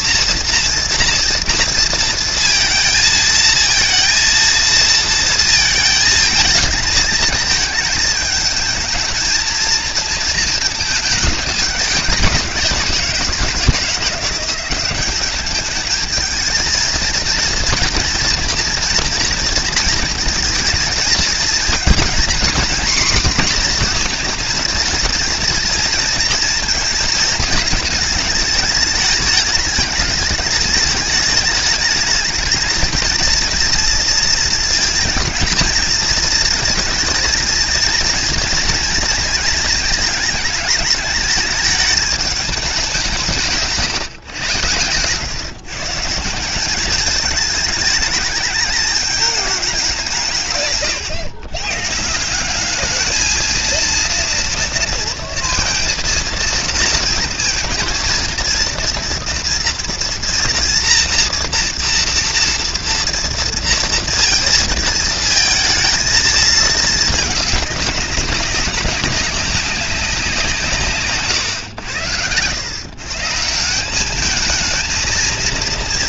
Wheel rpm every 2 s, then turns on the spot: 240, 220, 230, 220, 220, 220, 180, 180, 220, 230, 220, 250, 230, 230, 210, 210, 220, 230, 220, 230, 220, 210, 120, 190, 210, 140, 190, 230, 230, 230, 230, 230, 220, 220, 190, 170, 110, 220.
none